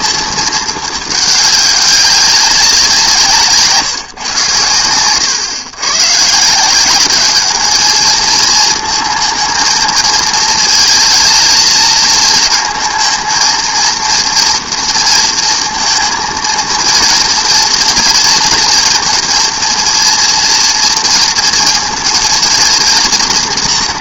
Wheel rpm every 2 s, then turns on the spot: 220, 190, 120, 170, 220, 220, 220, 230, 230, 230, 230, 230.
none